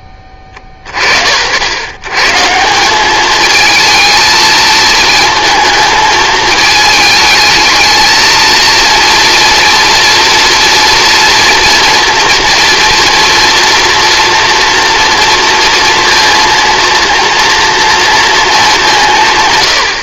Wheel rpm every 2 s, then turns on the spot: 50, 190, 220, 220, 230, 230, 240, 230, 230, 230.
none